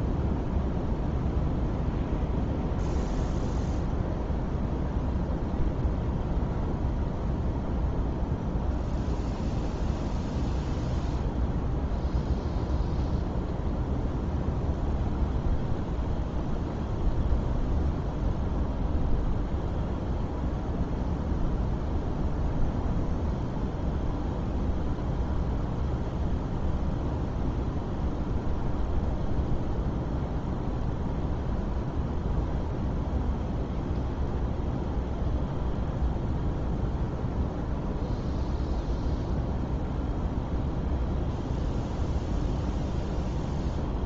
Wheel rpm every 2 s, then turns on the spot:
0, 0, 0, 0, 0, 0, 0, 0, 0, 0, 0, 0, 0, 0, 0, 0, 0, 0, 0, 0, 0, 0.
none